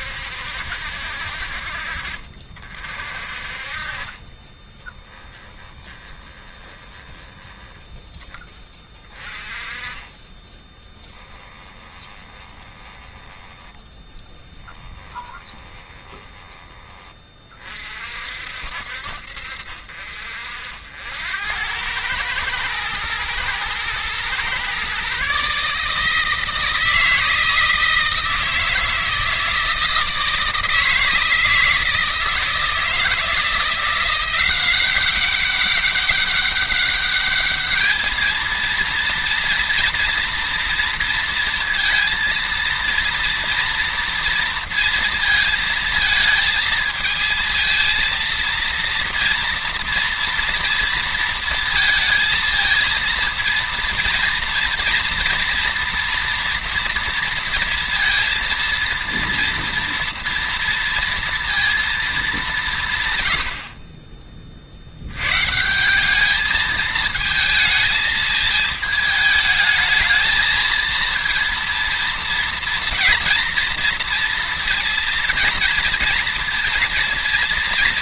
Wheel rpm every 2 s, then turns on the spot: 60, 50, 20, 10, 20, 10, 20, 10, 20, 60, 70, 110, 130, 160, 160, 160, 160, 190, 200, 230, 230, 230, 230, 220, 230, 230, 230, 230, 230, 230, 230, 150, 80, 220, 220, 220, 230, 230, 230.
4-8 10-16